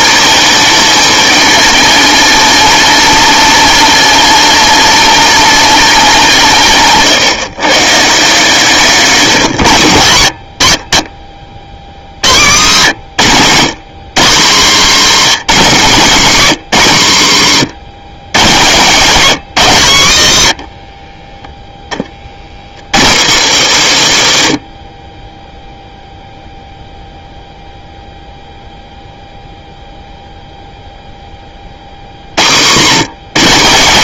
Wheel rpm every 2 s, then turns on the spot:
220, 210, 210, 150, 170, 90, 120, 220, 150, 150, 120, 50, 80, 0, 0, 0, 90.
20-22